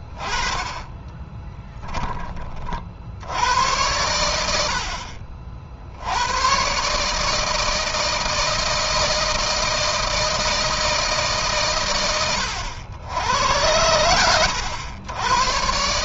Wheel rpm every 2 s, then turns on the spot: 10, 60, 60, 140, 160, 160, 100, 90.
0-2